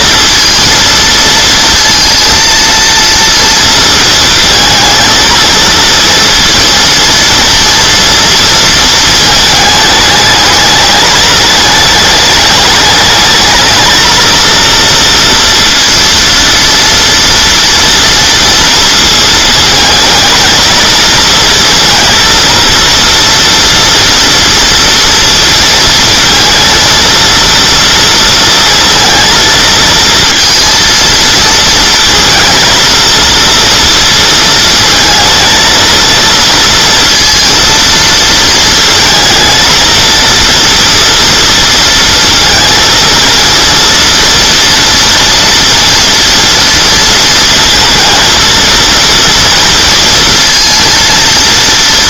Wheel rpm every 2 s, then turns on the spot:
230, 230, 230, 230, 230, 220, 210, 230, 230, 230, 230, 230, 230, 230, 230, 230, 230, 230, 230, 220, 230, 230, 230, 230, 230, 230.
none